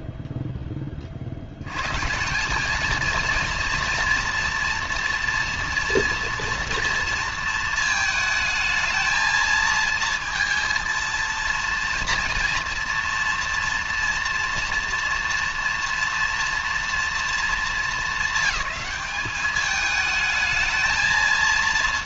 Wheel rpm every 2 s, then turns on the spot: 10, 210, 230, 240, 220, 230, 230, 230, 230, 200, 220.
none